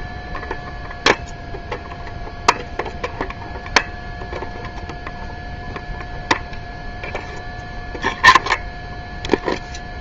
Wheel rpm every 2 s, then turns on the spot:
0, 0, 0, 0, 0.
none